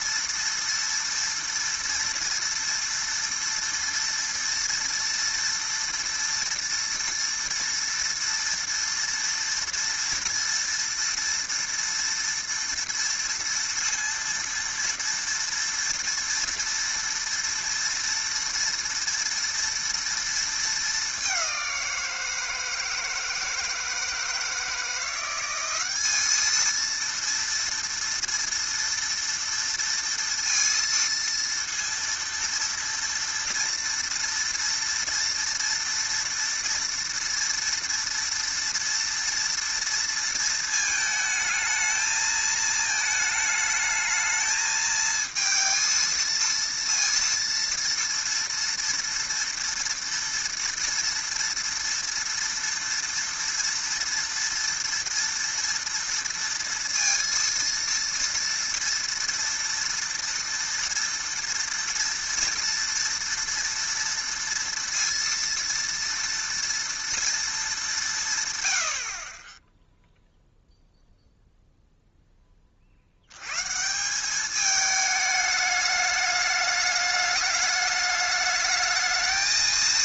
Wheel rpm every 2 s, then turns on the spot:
230, 230, 230, 230, 230, 230, 230, 230, 230, 230, 220, 160, 160, 220, 230, 230, 230, 240, 230, 230, 230, 220, 220, 230, 230, 230, 230, 230, 230, 230, 230, 230, 230, 230, 120, 0, 20, 210, 210, 210.
none